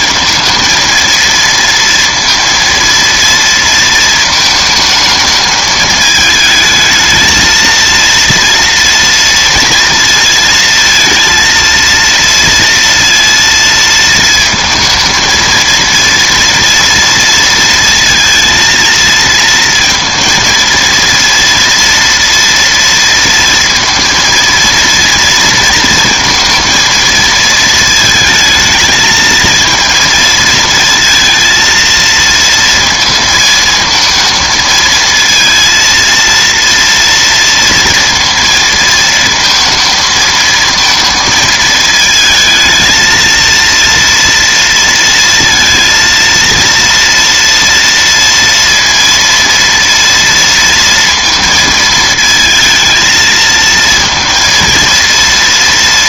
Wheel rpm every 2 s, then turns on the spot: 220, 230, 220, 220, 230, 230, 230, 220, 230, 230, 230, 230, 230, 230, 220, 230, 230, 230, 230, 230, 230, 230, 230, 230, 230, 230, 220, 230.
none